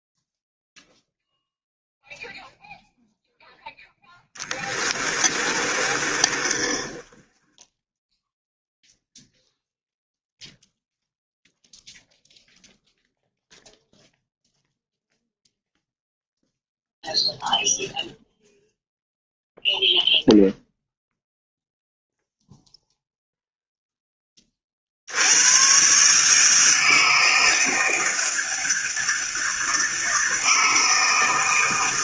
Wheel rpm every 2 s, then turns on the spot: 0, 0, 20, 20, 0, 0, 0, 0, 0, 0, 0, 0, 60, 160, 160, 160.
4-8